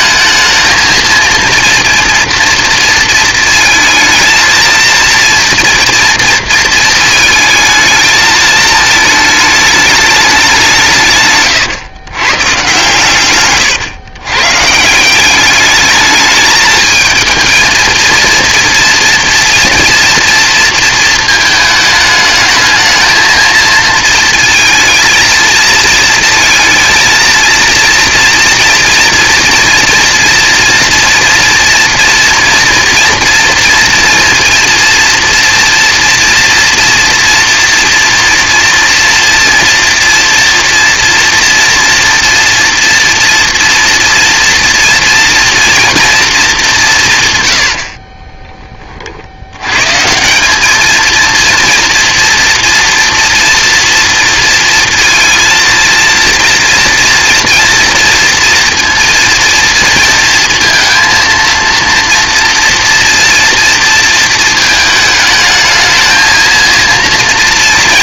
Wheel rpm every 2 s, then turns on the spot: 220, 230, 230, 230, 220, 170, 130, 150, 220, 230, 230, 220, 230, 230, 230, 240, 230, 230, 240, 230, 230, 240, 230, 200, 20, 200, 230, 230, 230, 230, 220, 230, 220, 230.
none